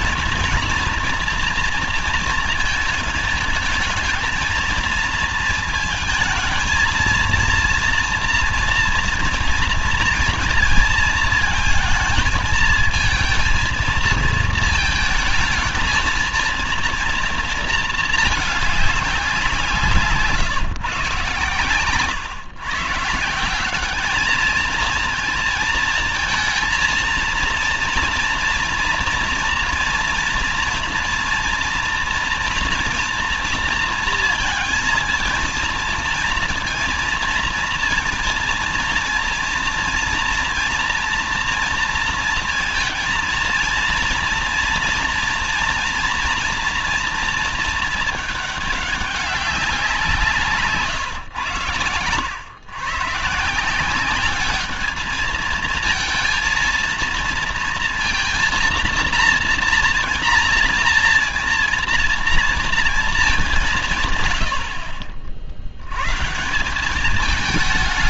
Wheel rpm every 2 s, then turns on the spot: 230, 230, 220, 220, 230, 230, 220, 220, 230, 210, 140, 130, 220, 230, 230, 230, 230, 230, 230, 230, 230, 230, 230, 230, 210, 150, 110, 210, 230, 230, 230, 230, 80, 160.
none